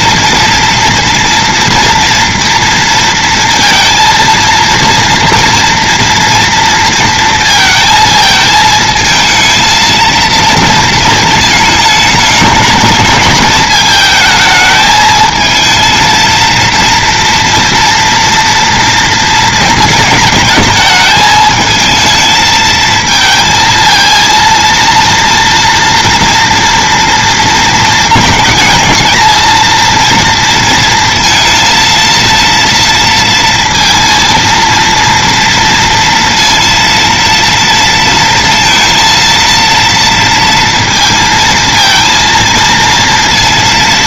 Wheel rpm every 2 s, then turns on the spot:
230, 230, 230, 230, 220, 230, 210, 220, 230, 230, 220, 220, 230, 230, 220, 230, 230, 230, 230, 230, 230, 230.
none